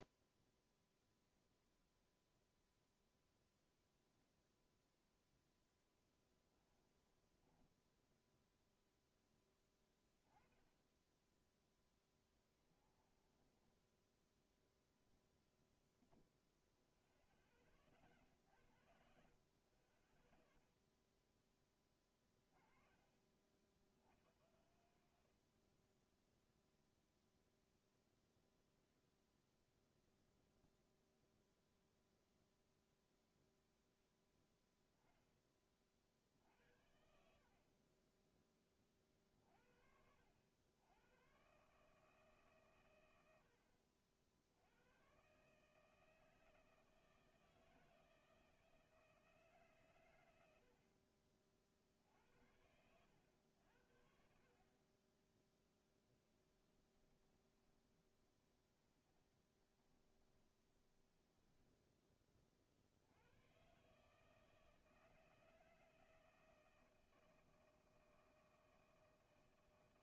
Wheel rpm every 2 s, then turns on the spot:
0, 0, 0, 10, 0, 30, 20, 0, 0, 60, 0, 20, 80, 0, 0, 0, 0, 0, 60, 20, 90, 130, 80, 160, 160, 80, 80, 40, 10, 20, 20, 40, 160, 160, 160.
6-8 12-14 56-62